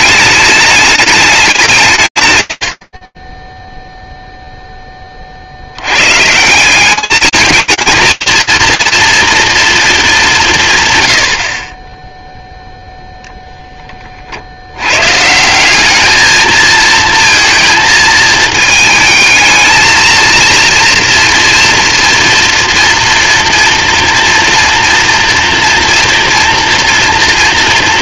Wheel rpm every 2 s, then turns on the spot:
210, 50, 10, 190, 230, 140, 0, 120, 230, 220, 230, 240, 230, 230.
none